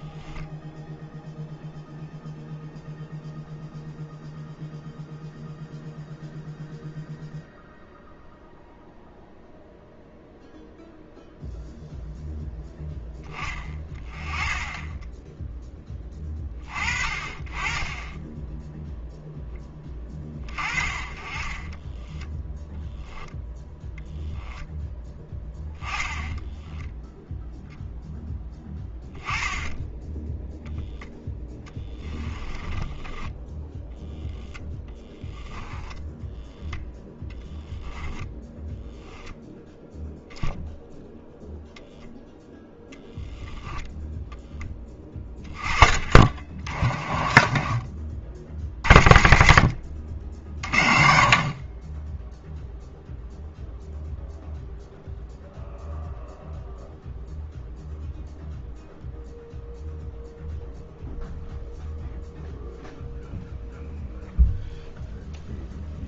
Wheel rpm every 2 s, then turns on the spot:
0, 0, 0, 0, 0, 0, 10, 10, 30, 0, 30, 10, 10, 0, 10, 0, 10, 10, 10, 0, 0, 0, 10, 40, 50, 40, 0, 0, 0, 0, 0, 0, 0.
46-48